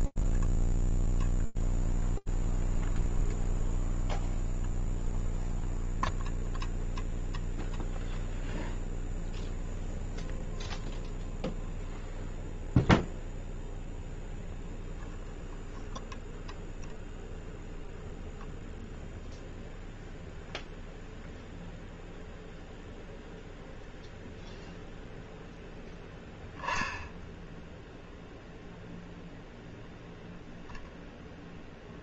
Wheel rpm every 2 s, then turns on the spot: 0, 0, 0, 0, 0, 0, 0, 0, 0, 0, 0, 0, 0, 0, 0, 0.
none